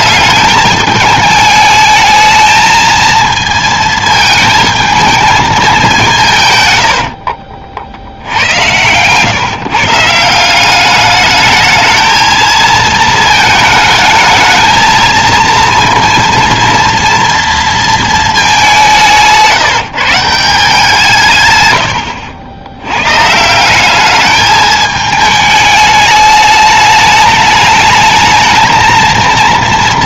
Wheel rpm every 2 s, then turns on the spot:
210, 220, 220, 120, 100, 190, 220, 220, 230, 200, 170, 90, 210, 210, 230.
none